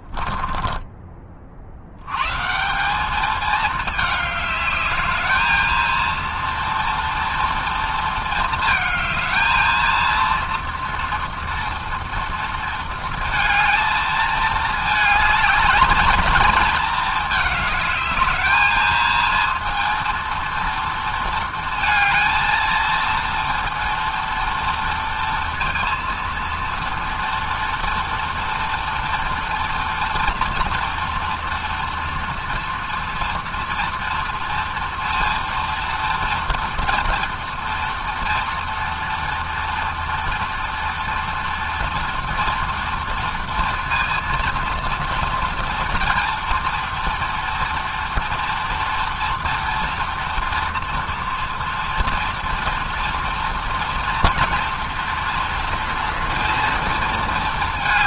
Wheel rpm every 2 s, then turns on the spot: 40, 220, 220, 230, 220, 230, 230, 220, 220, 230, 230, 230, 230, 230, 230, 230, 230, 230, 240, 230, 230, 230, 230, 230, 230, 230, 230, 230, 230.
none